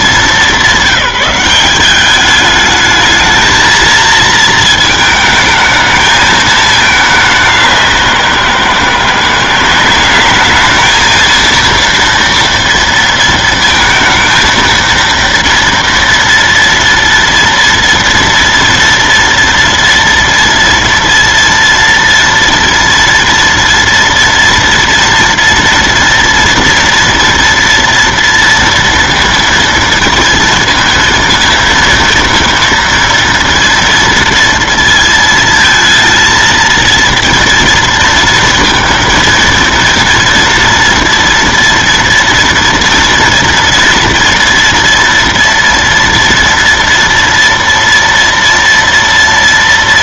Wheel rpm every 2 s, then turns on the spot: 200, 210, 220, 220, 190, 200, 230, 230, 240, 230, 230, 230, 230, 230, 230, 230, 230, 230, 230, 230, 230, 240, 230, 230, 230.
none